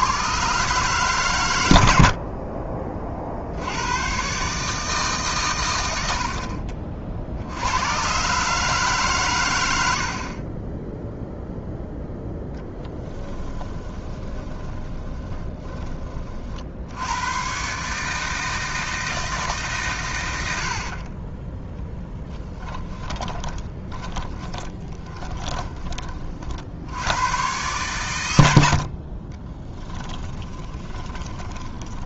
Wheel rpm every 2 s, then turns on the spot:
130, 40, 140, 40, 150, 20, 10, 20, 60, 160, 80, 10, 20, 40, 100, 10.
2-4 12-16 22-26 30-32